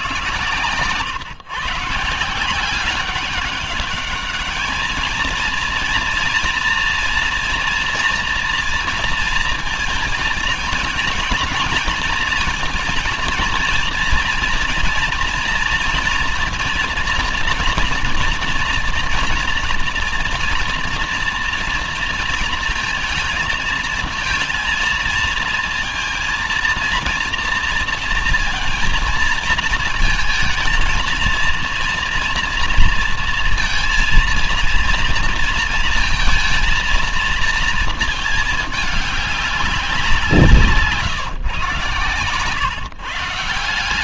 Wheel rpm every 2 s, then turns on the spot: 120, 180, 220, 230, 230, 230, 230, 230, 240, 230, 240, 220, 230, 230, 230, 220, 230, 230, 230, 210, 150, 140.
none